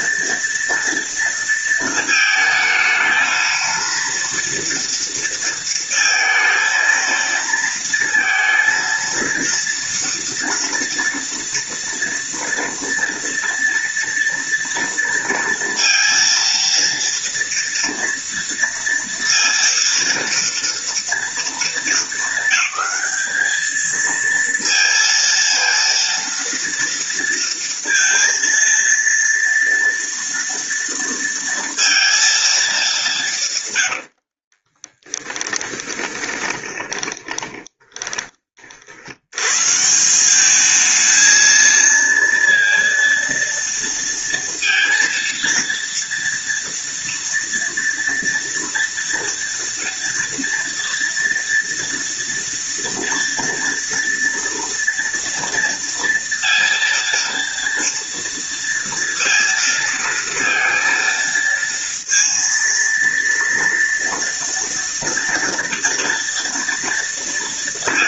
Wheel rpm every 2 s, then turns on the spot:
230, 220, 230, 230, 230, 240, 230, 230, 230, 230, 230, 220, 230, 230, 230, 230, 150, 10, 10, 100, 220, 230, 230, 230, 230, 240, 230, 230, 230, 230, 230, 230, 240, 230.
34-38